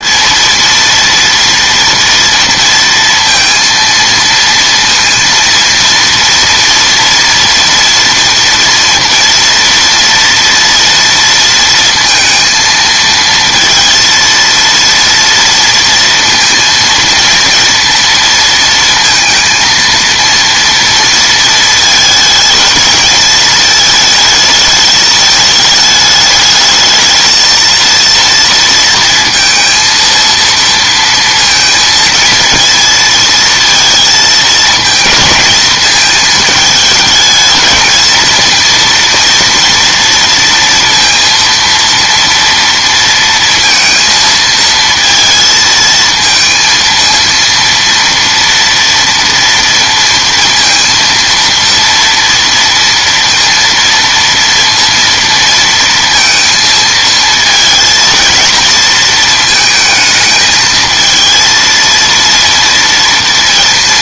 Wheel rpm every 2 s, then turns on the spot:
230, 230, 230, 230, 230, 230, 230, 230, 230, 230, 230, 220, 210, 220, 230, 230, 230, 230, 220, 230, 230, 230, 220, 230, 230, 230, 230, 230, 230, 230, 220, 230.
none